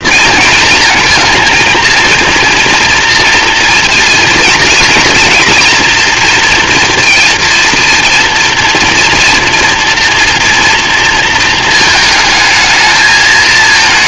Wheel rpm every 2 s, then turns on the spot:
220, 240, 230, 230, 230, 230, 220.
none